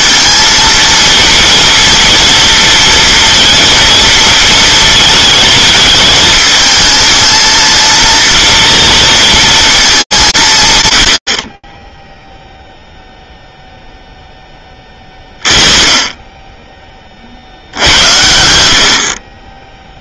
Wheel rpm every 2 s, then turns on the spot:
220, 230, 230, 220, 230, 130, 0, 20, 30, 60.
none